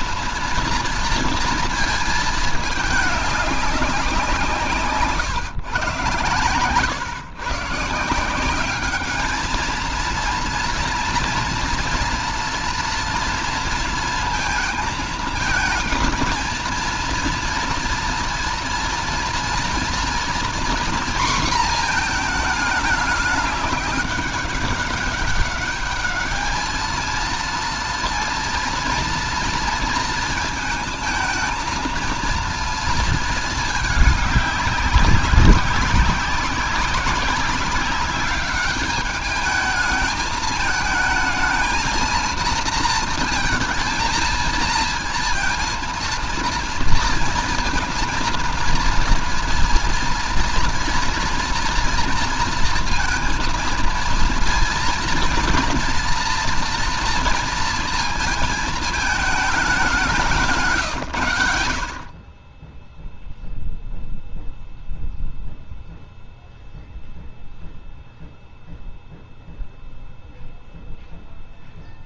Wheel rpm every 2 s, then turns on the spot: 230, 220, 160, 110, 190, 240, 230, 220, 230, 230, 230, 220, 200, 220, 230, 220, 230, 210, 200, 200, 220, 230, 230, 230, 230, 240, 230, 230, 230, 220, 140, 20, 0, 0, 0, 0.
none